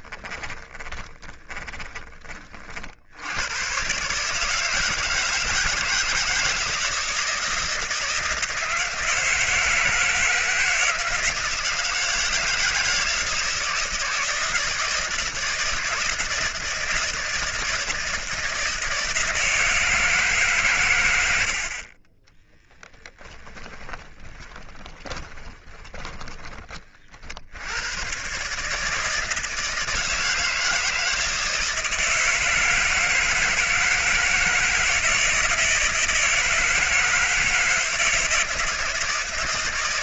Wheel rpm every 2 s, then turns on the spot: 20, 60, 160, 170, 160, 160, 160, 160, 160, 160, 110, 10, 20, 30, 160, 160, 160, 160, 160, 160.
0-2 22-26